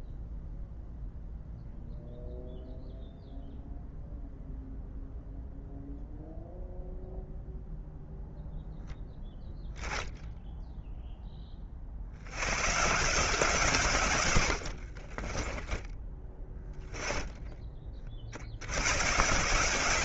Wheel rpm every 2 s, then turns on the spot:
0, 0, 0, 0, 0, 0, 130, 70, 20, 80.
14-16